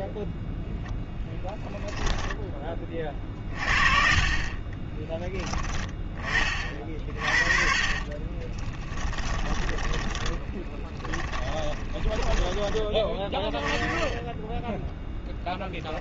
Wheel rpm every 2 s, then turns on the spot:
0, 30, 20, 30, 20, 20, 20, 10.
4-6 8-12